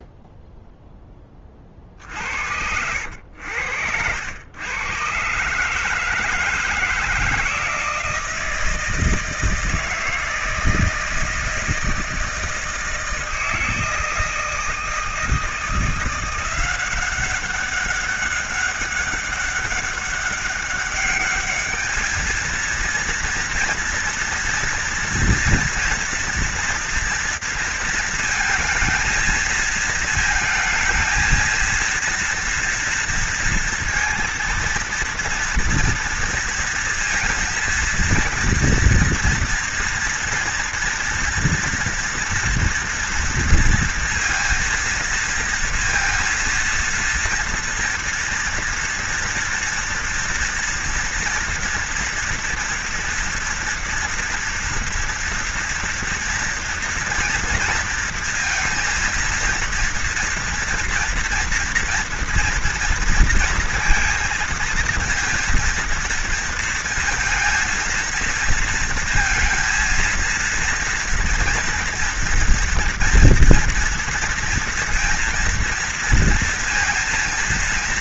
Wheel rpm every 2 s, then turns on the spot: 20, 90, 130, 160, 160, 160, 160, 160, 190, 200, 210, 230, 230, 230, 220, 230, 230, 240, 230, 230, 230, 230, 230, 230, 240, 230, 230, 230, 230, 230, 230, 230, 230, 230, 230, 230, 230, 230, 230.
none